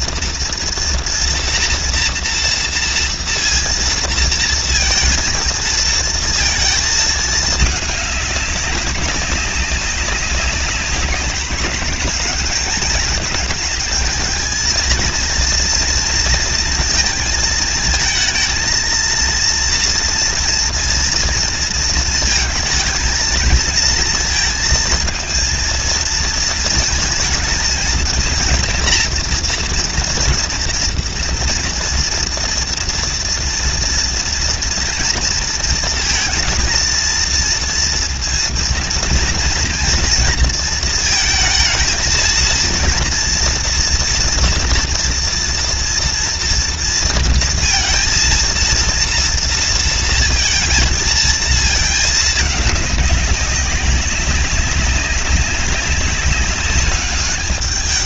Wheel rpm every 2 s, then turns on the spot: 240, 230, 230, 230, 200, 190, 210, 220, 230, 220, 230, 230, 220, 230, 230, 230, 230, 230, 230, 230, 230, 230, 240, 230, 230, 230, 210, 190, 200.
none